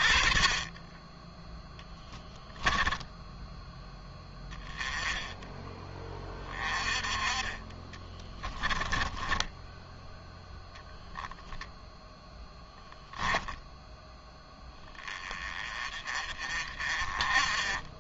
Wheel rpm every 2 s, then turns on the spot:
20, 10, 10, 20, 20, 0, 0, 20, 40.
2-4 8-10